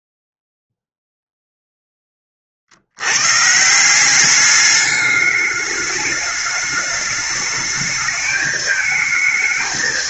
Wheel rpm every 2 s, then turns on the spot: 0, 30, 200, 210, 220.
none